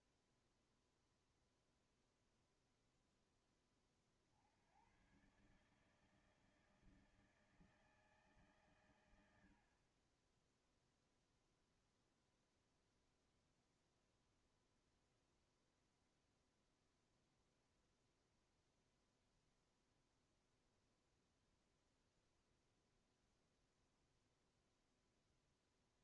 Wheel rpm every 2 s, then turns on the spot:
0, 0, 50, 150, 150, 30, 0, 0, 0, 0, 0, 0, 0.
none